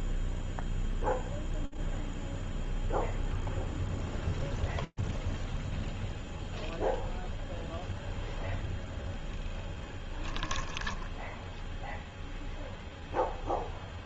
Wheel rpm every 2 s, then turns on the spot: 10, 0, 0, 0, 0, 0, 10.
none